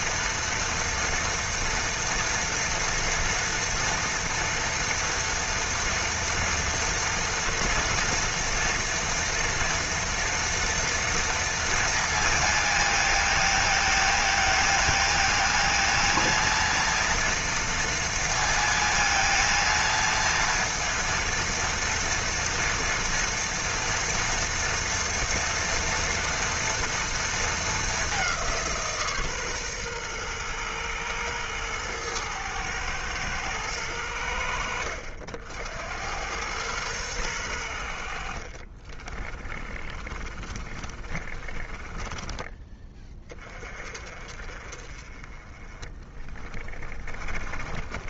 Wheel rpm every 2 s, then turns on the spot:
230, 230, 230, 230, 240, 230, 230, 220, 230, 230, 230, 230, 240, 230, 180, 120, 110, 70, 100, 40, 30, 20, 40, 20.
38-42